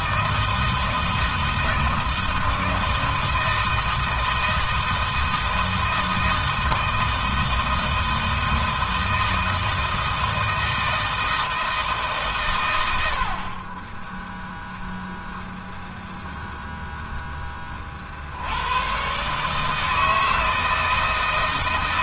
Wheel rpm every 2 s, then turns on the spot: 160, 160, 160, 160, 160, 160, 100, 0, 0, 100, 160.
none